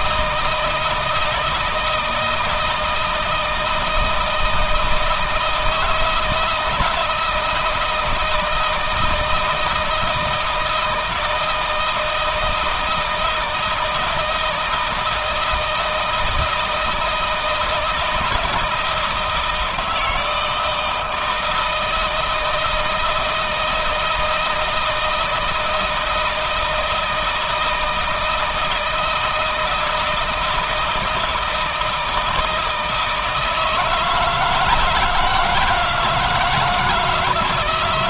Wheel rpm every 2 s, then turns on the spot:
160, 160, 160, 160, 160, 160, 160, 160, 160, 160, 160, 160, 160, 160, 170, 160, 160, 160, 160.
none